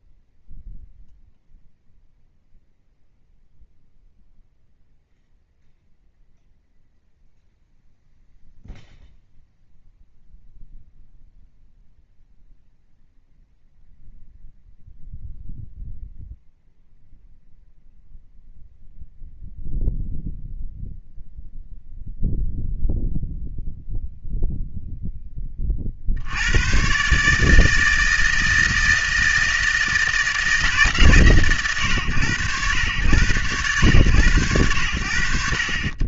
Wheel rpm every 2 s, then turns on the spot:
0, 0, 0, 0, 0, 0, 0, 0, 0, 0, 0, 0, 0, 110, 160, 150, 90, 80.
none